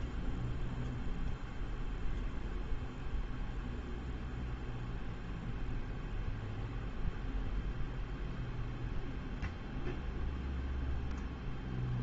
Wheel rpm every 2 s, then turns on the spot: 0, 0, 0, 0, 0, 0.
none